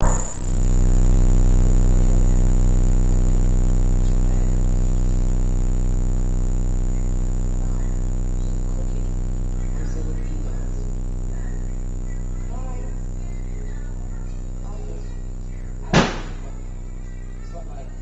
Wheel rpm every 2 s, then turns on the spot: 0, 0, 0, 0, 0, 0, 0, 0, 0.
none